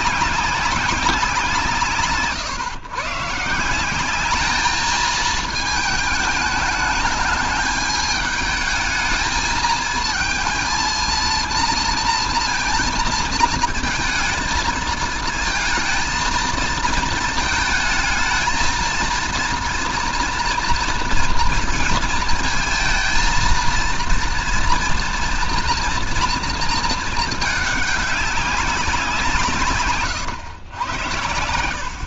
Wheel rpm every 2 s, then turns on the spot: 180, 130, 220, 210, 210, 230, 220, 220, 230, 230, 230, 230, 230, 230, 180, 100.
none